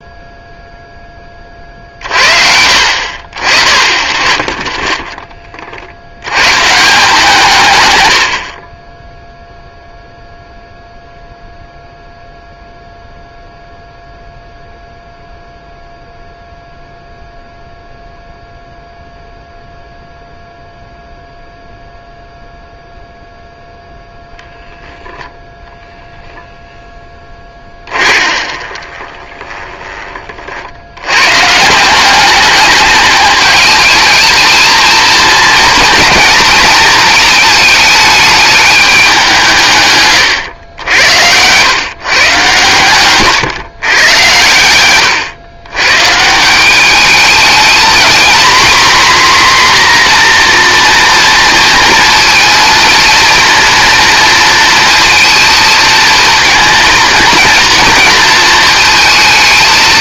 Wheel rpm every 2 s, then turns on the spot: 0, 60, 20, 150, 30, 0, 0, 0, 0, 0, 0, 0, 0, 0, 30, 60, 200, 220, 230, 210, 100, 130, 100, 190, 250, 240, 230, 230, 230, 230.
4-6 8-10 28-30